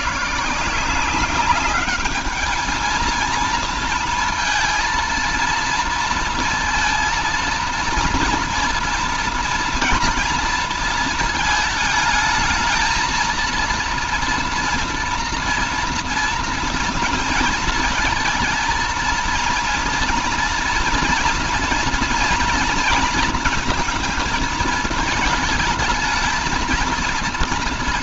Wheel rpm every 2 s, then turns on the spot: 160, 220, 230, 230, 230, 230, 220, 230, 230, 220, 230, 230, 220, 220.
none